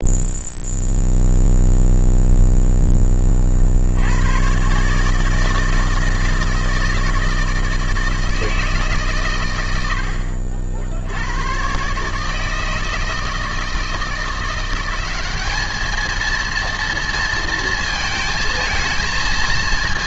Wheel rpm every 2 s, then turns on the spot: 0, 0, 120, 160, 160, 60, 160, 180, 230, 230.
none